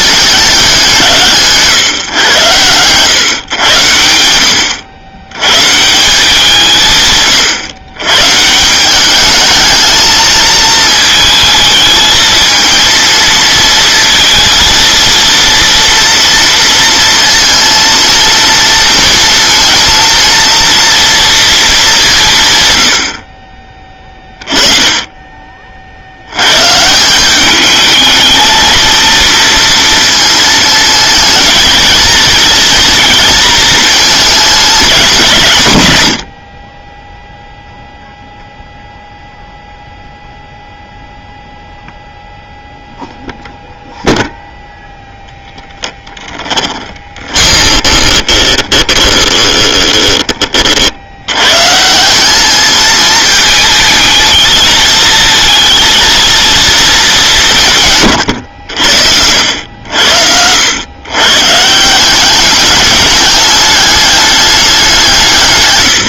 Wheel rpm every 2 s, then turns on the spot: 190, 120, 80, 170, 160, 220, 220, 230, 230, 230, 230, 120, 20, 130, 230, 220, 230, 220, 50, 0, 0, 0, 0, 20, 20, 40, 220, 220, 230, 90, 100, 210, 200.
46-50